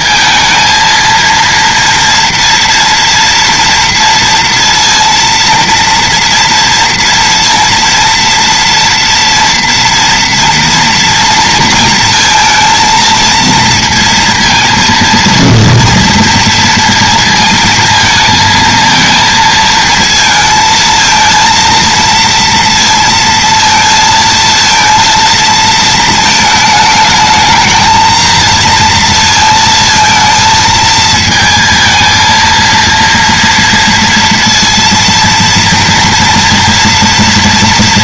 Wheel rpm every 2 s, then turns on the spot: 230, 230, 230, 230, 230, 230, 230, 230, 230, 220, 220, 230, 230, 220, 230, 220, 230, 230, 230.
none